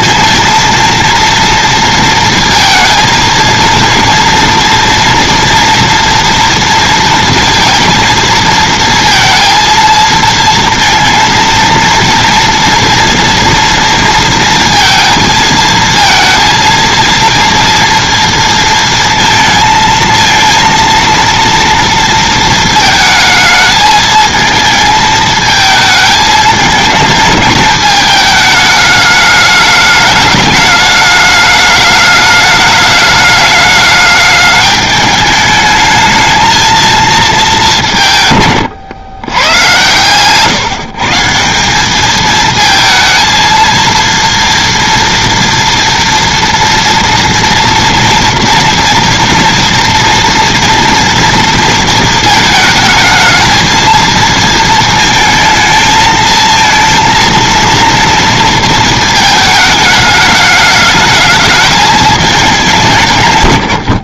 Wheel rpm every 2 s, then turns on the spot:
230, 230, 240, 230, 230, 230, 230, 230, 230, 230, 230, 220, 220, 220, 210, 210, 210, 210, 230, 110, 140, 220, 230, 230, 240, 240, 220, 220, 230, 220, 210, 160.
none